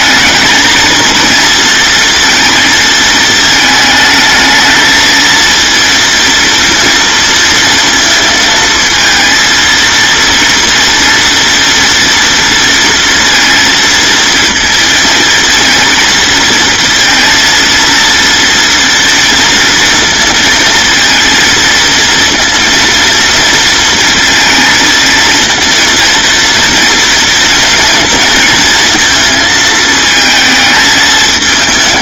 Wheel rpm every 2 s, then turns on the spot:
230, 220, 220, 230, 230, 240, 230, 230, 230, 240, 230, 230, 230, 230, 220, 220.
none